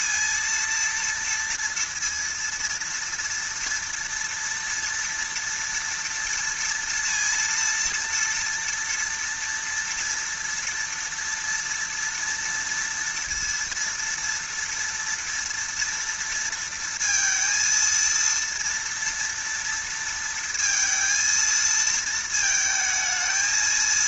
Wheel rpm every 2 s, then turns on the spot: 230, 230, 230, 230, 230, 230, 230, 230, 230, 230, 230, 220.
none